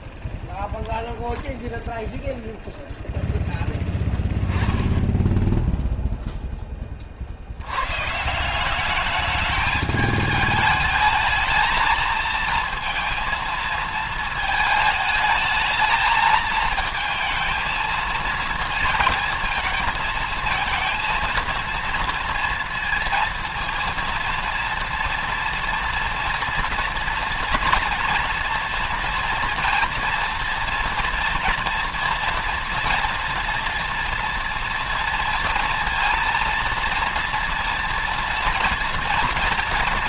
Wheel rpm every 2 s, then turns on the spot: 0, 0, 10, 30, 190, 220, 230, 220, 220, 220, 230, 230, 230, 240, 230, 230, 230, 230, 230, 230.
none